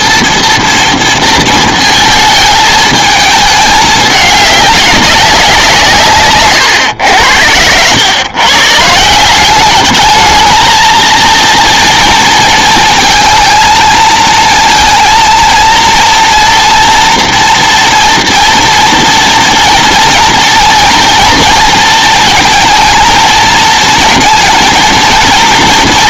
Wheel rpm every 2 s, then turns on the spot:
230, 220, 200, 120, 140, 220, 230, 230, 230, 240, 230, 230, 230.
none